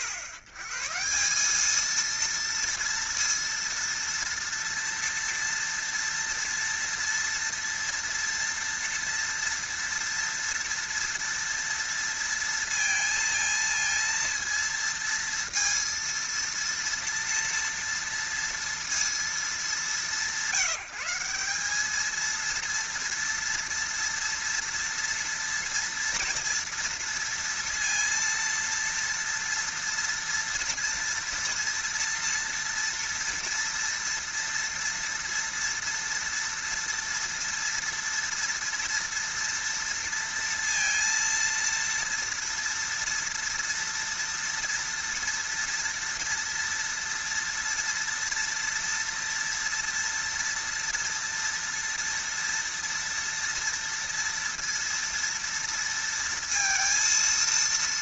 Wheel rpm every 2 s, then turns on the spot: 120, 230, 230, 230, 230, 230, 230, 230, 230, 230, 180, 230, 230, 230, 230, 240, 230, 230, 230, 230, 230, 230, 230, 230, 230, 230, 230, 230, 230.
none